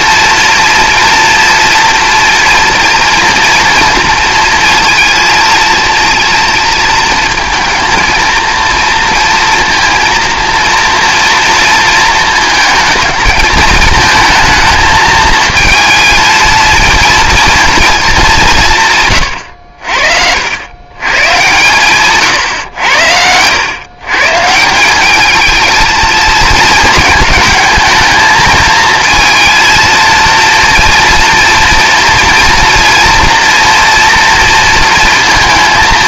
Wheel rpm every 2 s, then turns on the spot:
230, 230, 230, 230, 230, 230, 220, 220, 230, 180, 110, 110, 180, 220, 220, 230, 230, 230.
none